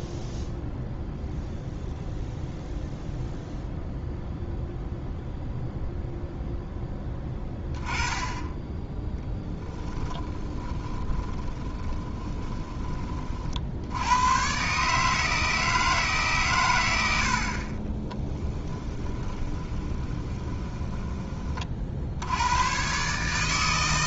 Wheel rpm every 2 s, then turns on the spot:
0, 0, 0, 10, 10, 20, 20, 140, 90, 10, 20, 130.
10-12 18-22